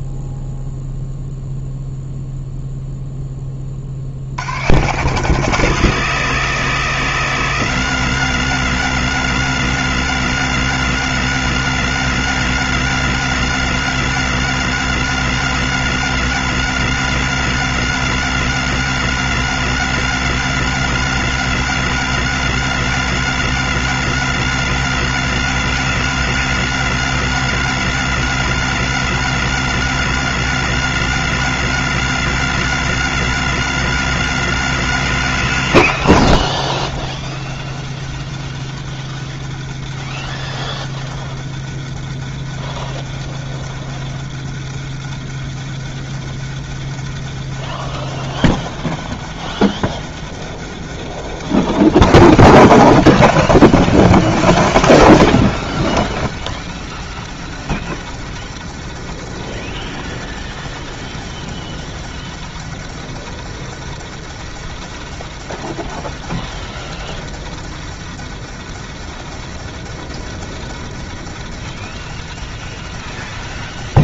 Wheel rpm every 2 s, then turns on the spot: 0, 0, 110, 90, 90, 90, 90, 90, 90, 90, 90, 90, 90, 90, 90, 90, 90, 100, 110, 110, 110, 110, 110, 110, 110, 110, 140, 150, 110, 100, 110, 110, 110, 110, 100, 110, 100.
none